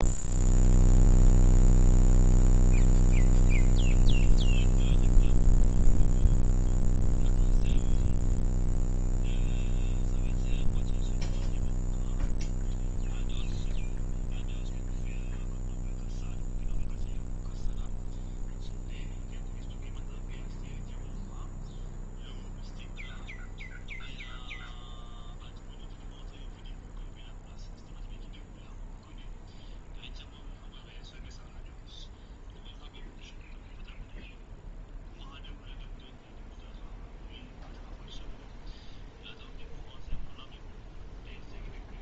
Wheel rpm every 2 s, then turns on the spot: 0, 0, 0, 0, 0, 0, 0, 0, 0, 0, 0, 0, 0, 0, 0, 0, 0, 0, 0, 0, 0.
none